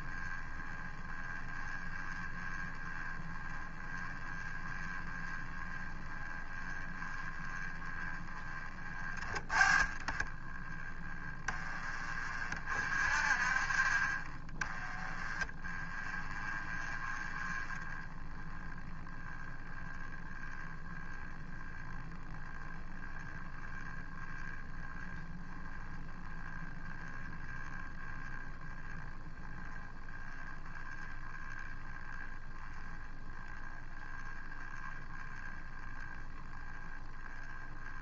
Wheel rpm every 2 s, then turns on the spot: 20, 20, 20, 20, 20, 20, 40, 30, 30, 10, 10, 10, 10, 10, 10, 0, 10, 10, 10.
none